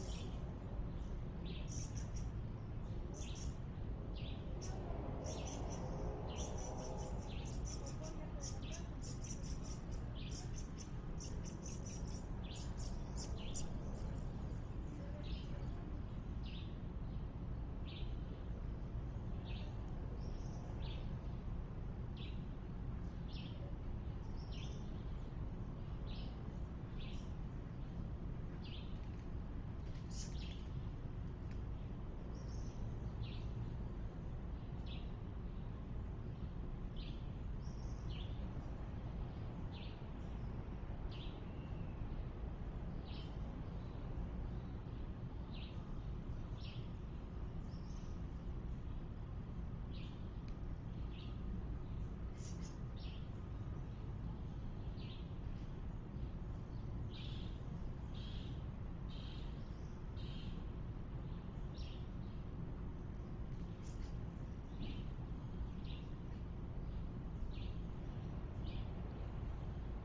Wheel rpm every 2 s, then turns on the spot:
0, 0, 0, 0, 0, 0, 0, 0, 0, 0, 0, 0, 0, 0, 0, 0, 0, 0, 0, 0, 0, 0, 0, 0, 0, 0, 0, 0, 0, 0, 0, 0, 0, 0, 0.
none